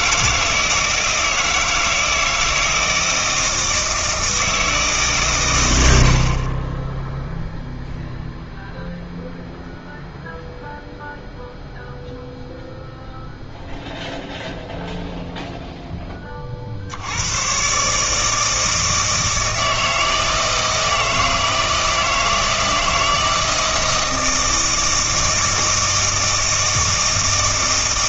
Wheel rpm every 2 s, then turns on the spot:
160, 160, 160, 20, 0, 0, 0, 0, 50, 160, 160, 160, 160, 160.
none